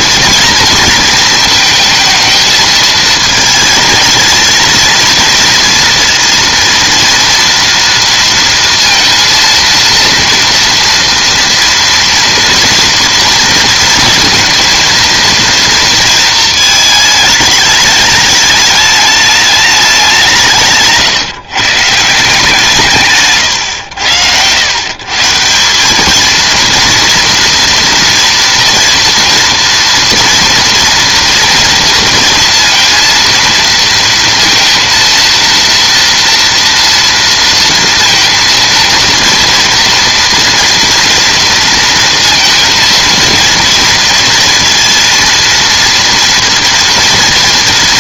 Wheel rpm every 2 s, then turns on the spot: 230, 220, 230, 230, 230, 240, 230, 230, 220, 210, 150, 170, 110, 230, 230, 230, 230, 230, 230, 230, 230, 230, 230, 230.
none